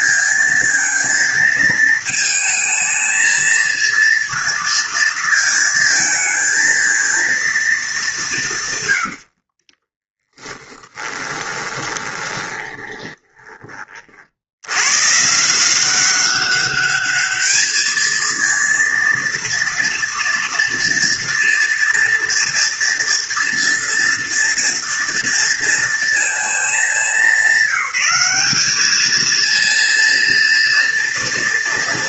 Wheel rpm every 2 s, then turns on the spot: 230, 220, 230, 220, 120, 10, 20, 100, 200, 230, 230, 230, 230, 220, 210, 230.
8-14